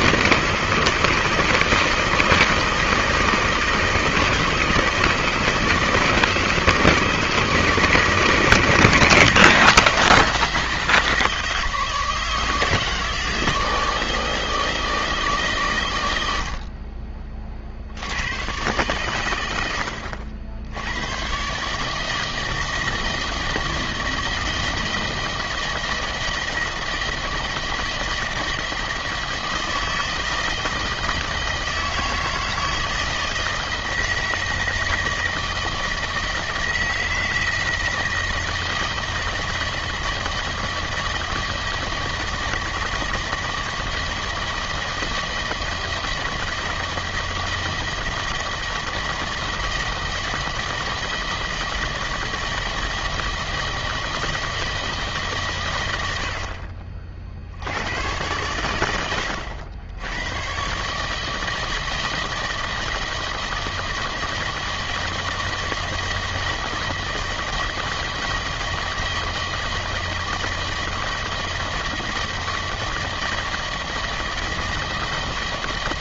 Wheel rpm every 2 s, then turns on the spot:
160, 160, 160, 160, 160, 160, 160, 160, 40, 120, 90, 160, 160, 160, 160, 160, 160, 160, 160, 160, 160, 160, 160, 160, 160, 160, 160, 150, 40, 100, 140, 160, 160, 160, 160, 160, 160, 160.
none